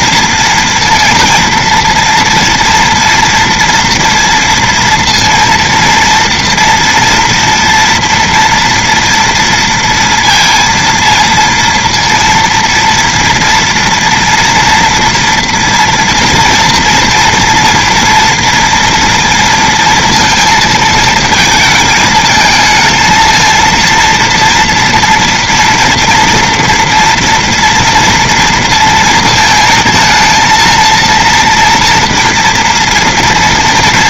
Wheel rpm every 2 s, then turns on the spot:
230, 230, 230, 230, 230, 230, 230, 230, 230, 230, 220, 220, 230, 230, 230, 230, 230.
none